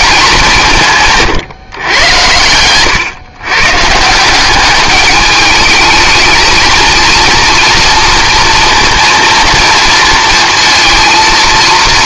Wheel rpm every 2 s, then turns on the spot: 180, 110, 200, 230, 230, 230.
none